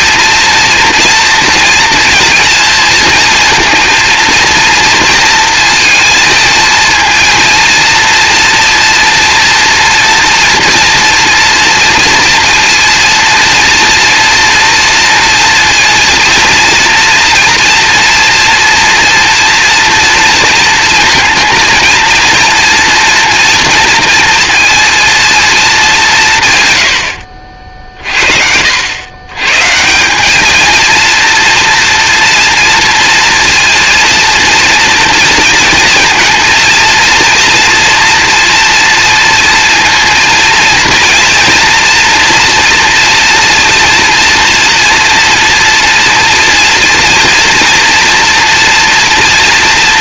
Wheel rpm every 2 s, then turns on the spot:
230, 230, 230, 230, 230, 240, 230, 230, 230, 230, 230, 230, 230, 100, 80, 220, 230, 230, 230, 230, 230, 230, 230, 230, 230.
none